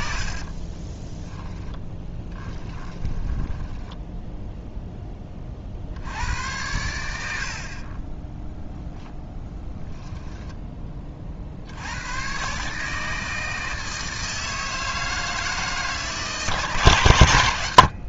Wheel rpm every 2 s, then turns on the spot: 20, 10, 10, 90, 0, 10, 140, 160, 150.
0-4